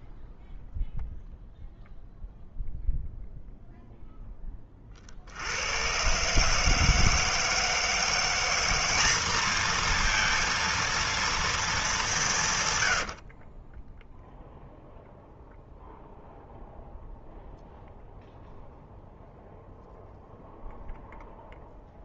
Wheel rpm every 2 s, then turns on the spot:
0, 0, 10, 140, 180, 230, 170, 0, 0, 0, 0.
none